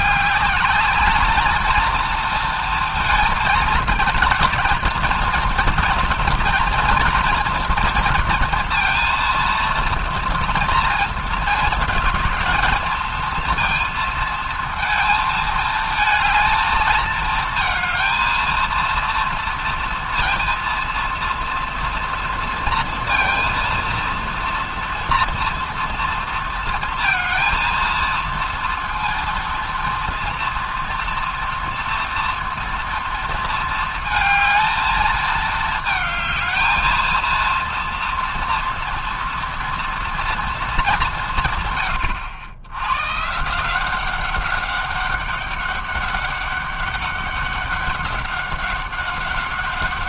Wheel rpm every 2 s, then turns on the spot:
200, 230, 230, 240, 230, 230, 220, 220, 220, 230, 230, 230, 230, 230, 230, 230, 240, 220, 220, 230, 220, 90, 190, 200, 200.
none